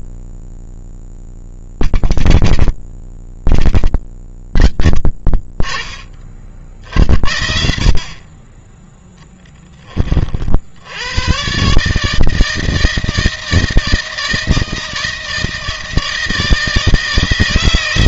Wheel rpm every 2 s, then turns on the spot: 10, 50, 50, 50, 30, 40, 160, 160, 160.
none